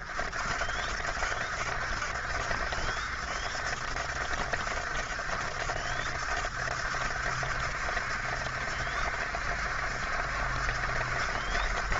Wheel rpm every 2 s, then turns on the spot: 60, 70, 70, 70, 70, 70.
none